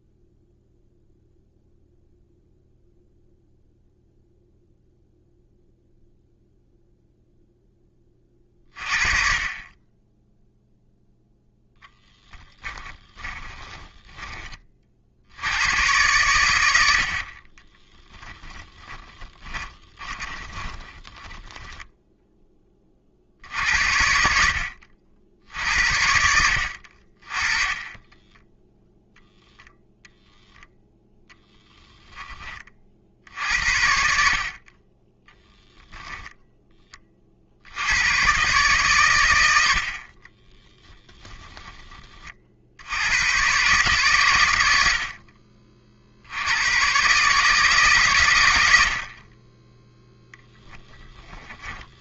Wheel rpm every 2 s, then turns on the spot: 0, 0, 0, 0, 40, 0, 10, 50, 70, 20, 20, 30, 60, 50, 0, 0, 40, 30, 30, 130, 20, 80, 70, 120, 70, 20.
12-14 16-22 40-42 50-52